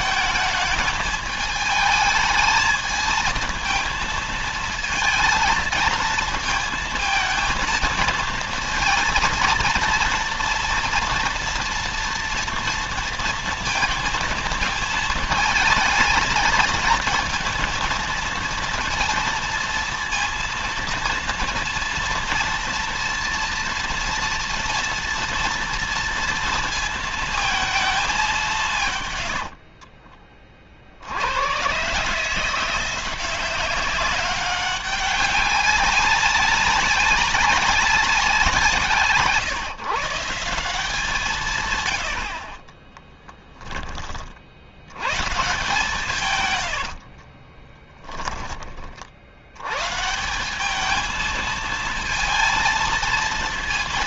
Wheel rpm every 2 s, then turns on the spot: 210, 220, 230, 230, 230, 230, 230, 220, 220, 230, 230, 230, 230, 230, 130, 60, 180, 200, 200, 160, 170, 20, 90, 90, 40, 200, 230.
28-30 42-44 46-48